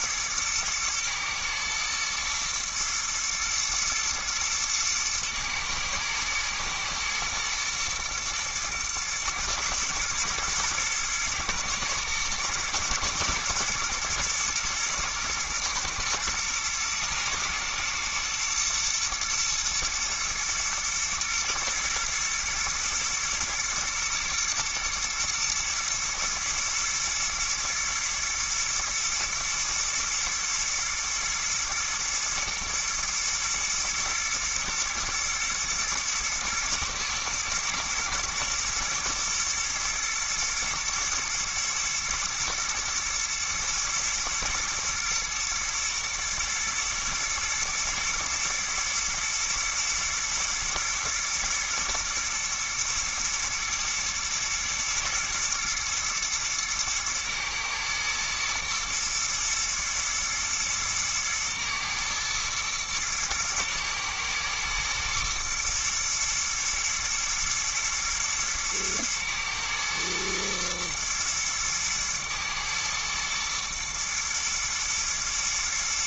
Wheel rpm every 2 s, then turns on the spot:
110, 120, 120, 110, 110, 110, 110, 110, 110, 110, 110, 110, 110, 110, 110, 120, 110, 110, 110, 120, 120, 110, 110, 120, 110, 110, 110, 120, 110, 110, 110, 110, 110, 110, 110, 110, 110, 110.
none